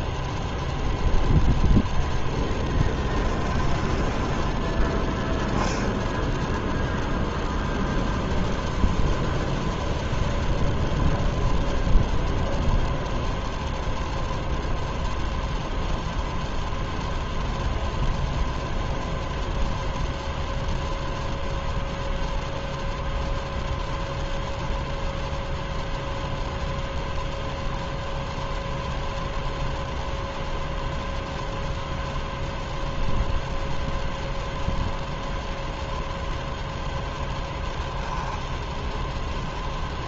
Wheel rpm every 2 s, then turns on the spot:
0, 10, 20, 0, 0, 0, 0, 0, 0, 0, 0, 0, 0, 0, 0, 0, 0, 0, 0, 10.
2-6